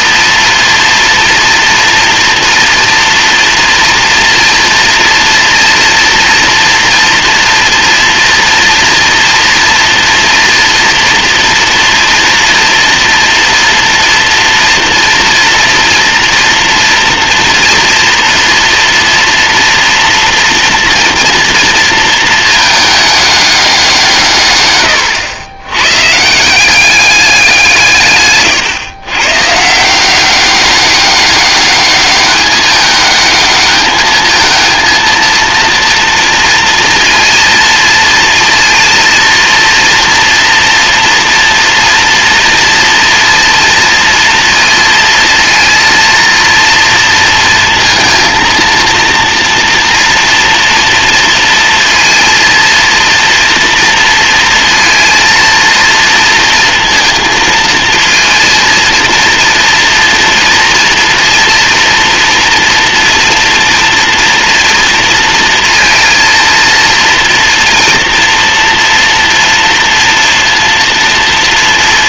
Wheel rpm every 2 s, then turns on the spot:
230, 230, 230, 240, 230, 240, 230, 230, 230, 230, 230, 210, 110, 190, 120, 200, 210, 230, 230, 230, 230, 230, 230, 230, 230, 230, 230, 230, 230, 230, 230, 230, 230, 230, 230, 230.
24-26